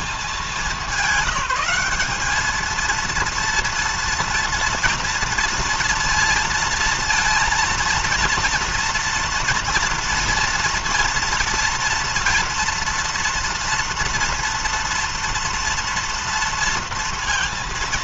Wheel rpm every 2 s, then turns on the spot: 200, 210, 230, 230, 230, 230, 230, 230, 230.
none